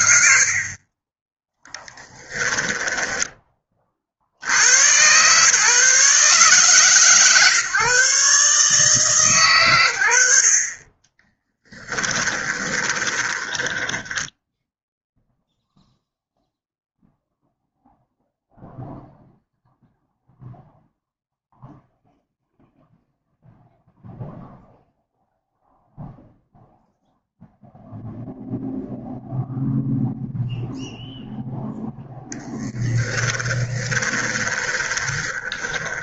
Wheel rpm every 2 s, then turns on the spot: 30, 10, 110, 140, 150, 30, 30, 0, 0, 0, 0, 0, 0, 0, 0, 0, 10, 20.
0-2 10-14 32-36